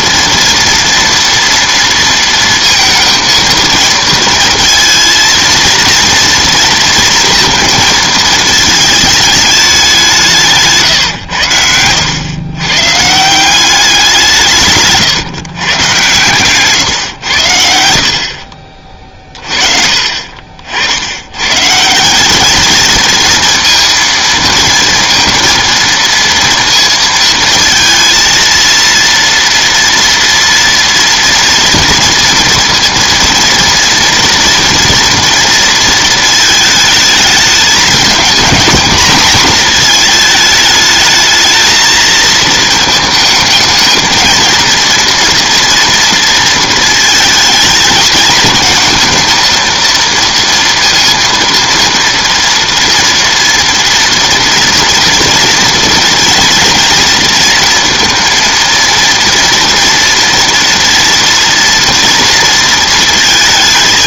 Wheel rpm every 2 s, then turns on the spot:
230, 230, 230, 230, 220, 160, 130, 140, 130, 40, 60, 220, 230, 230, 230, 230, 230, 230, 220, 230, 220, 220, 230, 220, 220, 230, 230, 230, 230, 230, 230, 230.
16-18